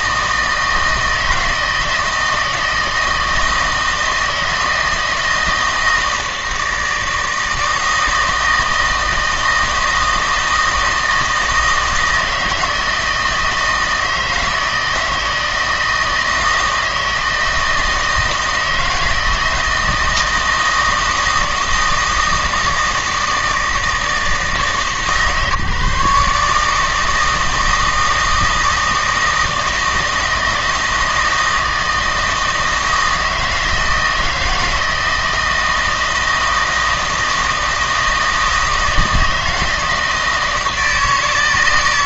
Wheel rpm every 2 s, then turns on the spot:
160, 160, 160, 160, 160, 160, 160, 160, 160, 160, 160, 160, 150, 150, 160, 160, 160, 160, 160, 160, 160.
none